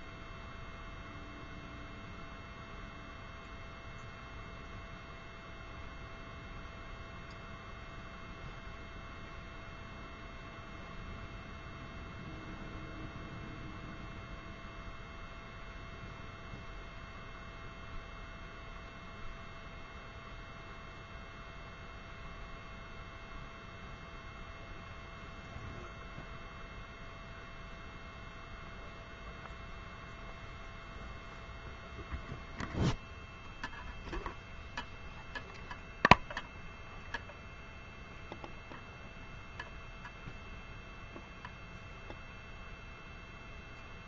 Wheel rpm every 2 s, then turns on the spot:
0, 0, 0, 0, 0, 0, 0, 0, 0, 0, 0, 0, 0, 0, 0, 0, 0, 0, 0, 0, 0, 0.
none